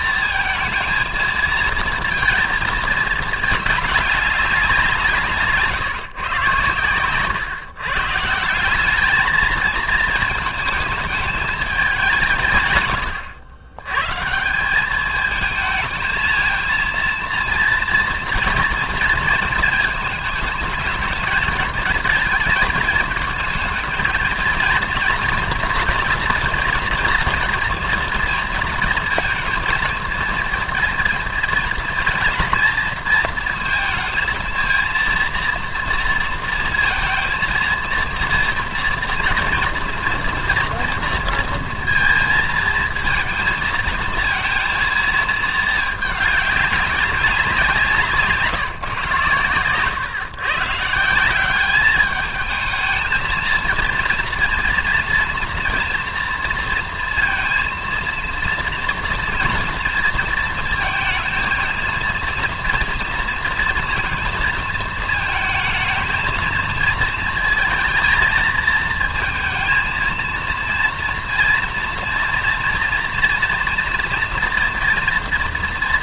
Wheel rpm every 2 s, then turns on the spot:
230, 220, 190, 140, 170, 220, 130, 170, 230, 230, 220, 220, 230, 240, 230, 230, 230, 230, 230, 240, 240, 230, 230, 200, 150, 130, 220, 230, 230, 240, 230, 230, 220, 230, 230, 230, 230, 230.
none